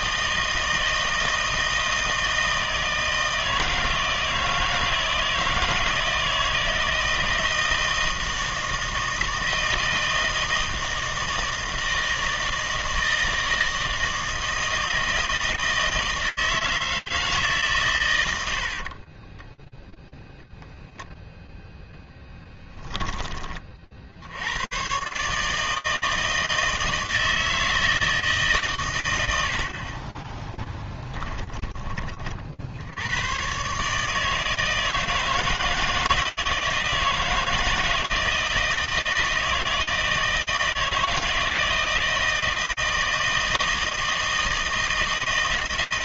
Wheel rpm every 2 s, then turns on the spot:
160, 160, 160, 160, 160, 160, 160, 160, 160, 70, 0, 10, 120, 160, 140, 10, 80, 160, 160, 160, 160, 160, 160.
18-20 22-24 30-32